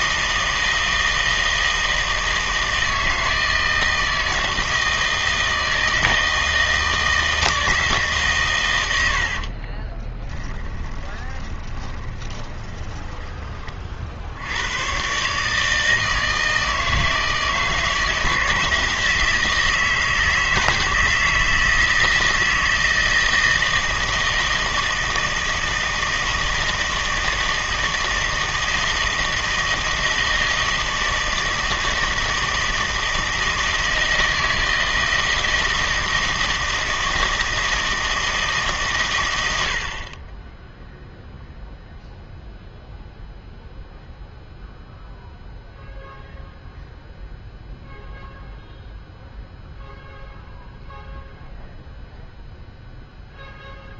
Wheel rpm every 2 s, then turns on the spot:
160, 160, 160, 160, 120, 10, 20, 90, 160, 160, 160, 160, 160, 160, 160, 160, 160, 160, 160, 150, 10, 0, 0, 0, 0, 0, 0.
10-14